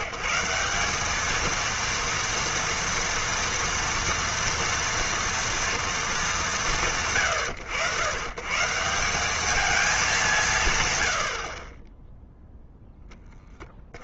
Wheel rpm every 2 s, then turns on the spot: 170, 230, 230, 180, 160, 140, 0.
none